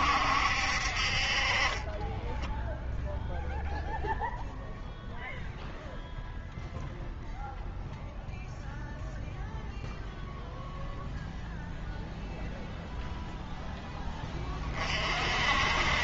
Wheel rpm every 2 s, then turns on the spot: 60, 10, 0, 0, 0, 0, 0, 30.
none